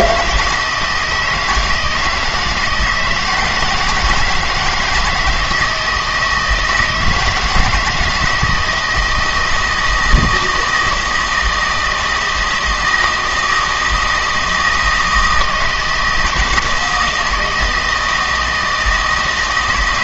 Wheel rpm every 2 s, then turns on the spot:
160, 160, 160, 160, 160, 160, 160, 160, 170, 160.
none